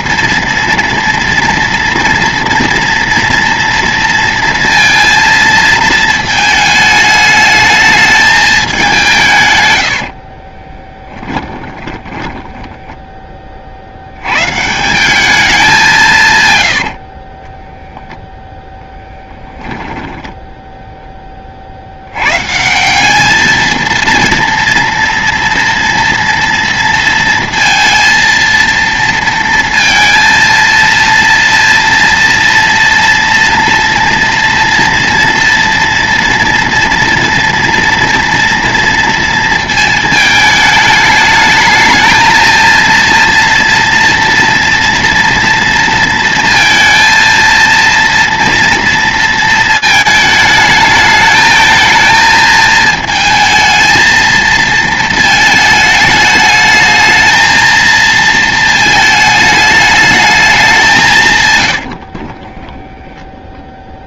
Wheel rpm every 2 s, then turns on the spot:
230, 230, 230, 220, 210, 60, 10, 120, 140, 0, 0, 110, 230, 230, 230, 230, 230, 230, 230, 230, 220, 230, 230, 230, 230, 220, 220, 220, 210, 220, 200, 30.
10-12 62-64